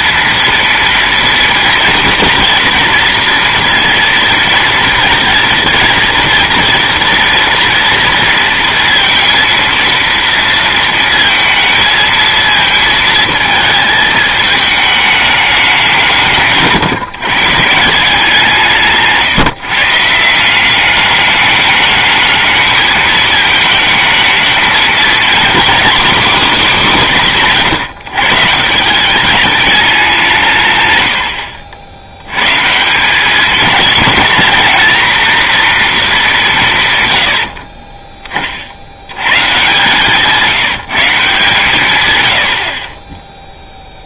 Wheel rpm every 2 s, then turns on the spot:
230, 230, 230, 230, 230, 230, 230, 210, 150, 160, 190, 220, 220, 240, 160, 120, 140, 220, 170, 40, 170, 60.
none